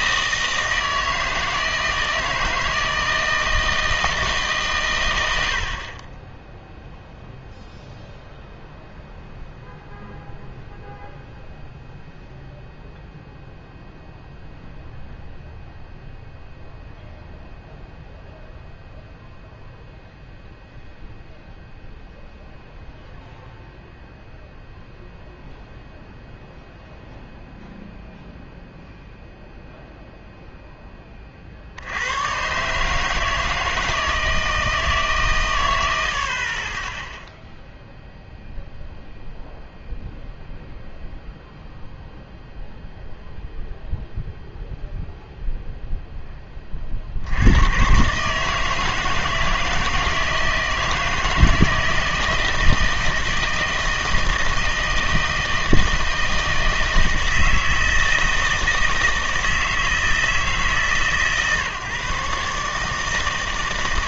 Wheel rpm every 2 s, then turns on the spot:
160, 160, 150, 0, 0, 0, 0, 0, 0, 0, 0, 0, 0, 0, 0, 10, 130, 160, 30, 0, 0, 0, 0, 20, 150, 160, 160, 160, 160, 160, 150, 150.
none